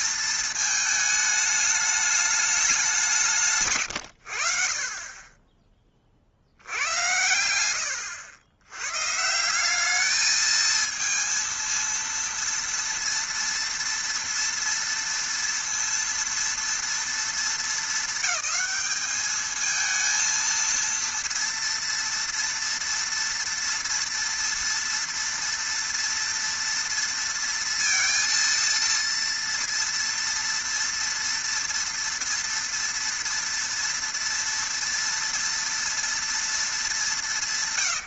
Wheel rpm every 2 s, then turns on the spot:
220, 200, 50, 80, 90, 220, 230, 230, 230, 210, 230, 240, 230, 230, 230, 230, 230, 230, 230.
none